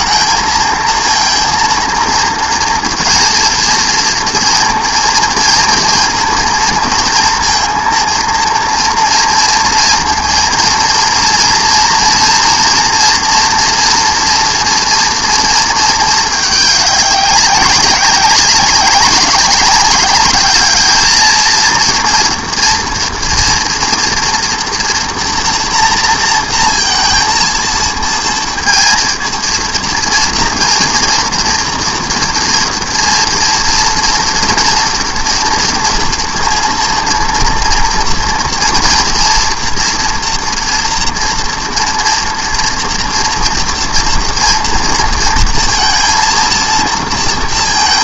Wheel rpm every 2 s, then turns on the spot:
230, 230, 230, 230, 230, 230, 240, 230, 200, 190, 220, 240, 230, 230, 230, 230, 230, 230, 230, 230, 230, 230, 230, 230.
none